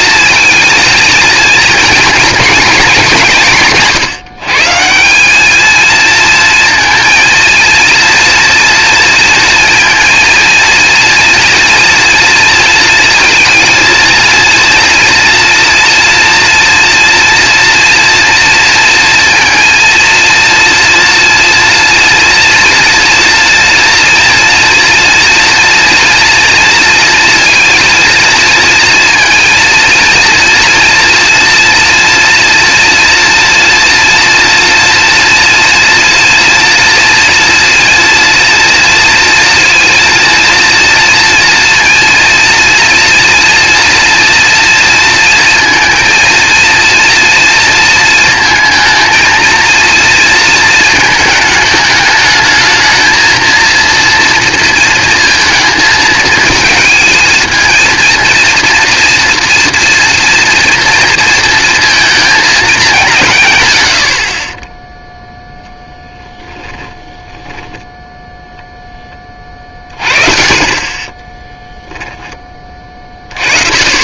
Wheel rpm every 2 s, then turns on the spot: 230, 220, 170, 230, 230, 230, 230, 230, 230, 230, 230, 230, 230, 230, 230, 240, 230, 230, 230, 230, 230, 230, 230, 230, 230, 220, 230, 230, 220, 230, 230, 200, 20, 10, 10, 30, 30.
66-68